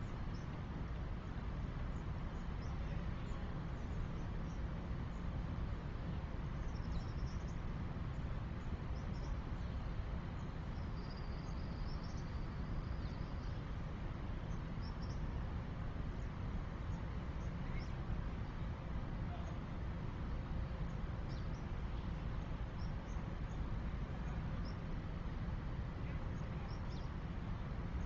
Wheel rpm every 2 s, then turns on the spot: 0, 0, 0, 0, 0, 0, 0, 0, 0, 0, 0, 0, 0, 0.
none